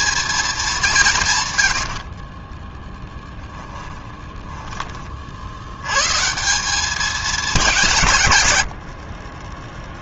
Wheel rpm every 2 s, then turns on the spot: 200, 10, 30, 200, 70.
2-4